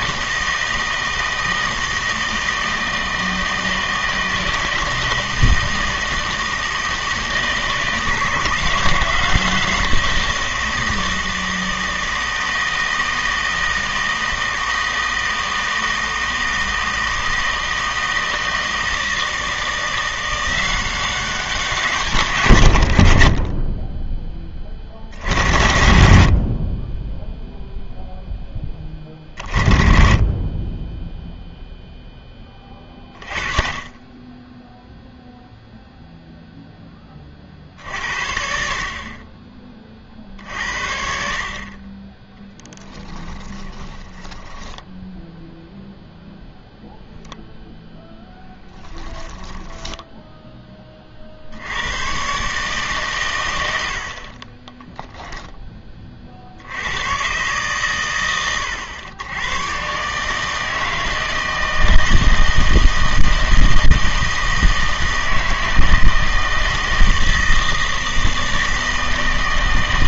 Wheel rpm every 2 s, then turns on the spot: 160, 160, 160, 160, 170, 170, 160, 160, 160, 160, 180, 130, 40, 60, 10, 20, 20, 0, 0, 50, 60, 10, 0, 0, 10, 20, 140, 20, 80, 90, 160, 160, 160, 160, 160.
42-44 48-50 54-56